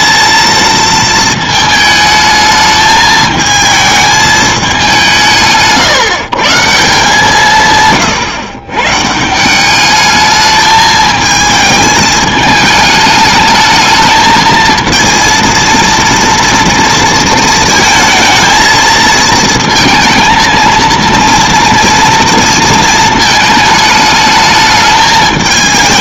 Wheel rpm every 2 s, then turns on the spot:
230, 220, 200, 160, 140, 220, 210, 230, 230, 220, 230, 230, 220.
none